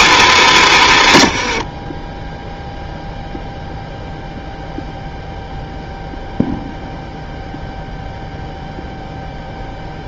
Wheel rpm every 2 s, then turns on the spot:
90, 0, 0, 0, 0.
0-2